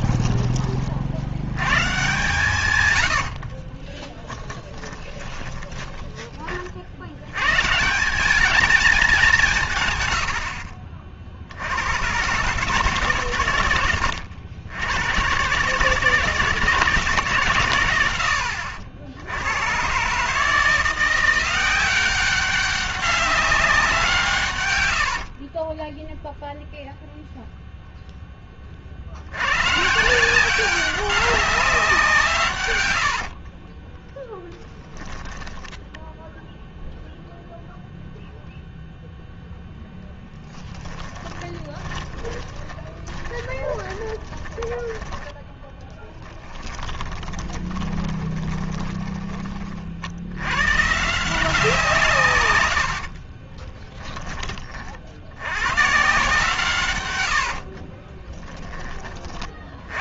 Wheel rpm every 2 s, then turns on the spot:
30, 120, 10, 50, 210, 50, 140, 90, 170, 70, 160, 200, 100, 0, 40, 190, 100, 10, 0, 0, 10, 20, 20, 10, 30, 130, 100, 40, 130, 10.
4-6 40-44 46-50